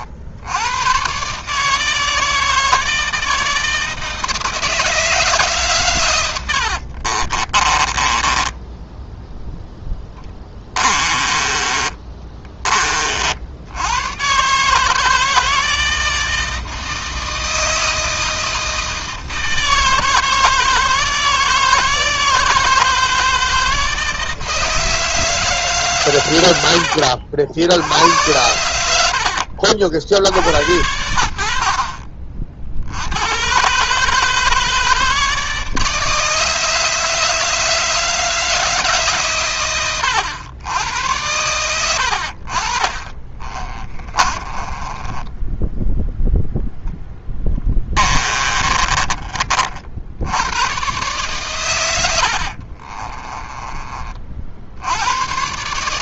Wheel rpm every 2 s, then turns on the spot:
120, 160, 160, 60, 10, 30, 40, 160, 160, 160, 160, 160, 160, 70, 80, 70, 80, 150, 150, 150, 90, 30, 20, 0, 20, 120, 40, 90.
6-12 42-46 48-50 52-54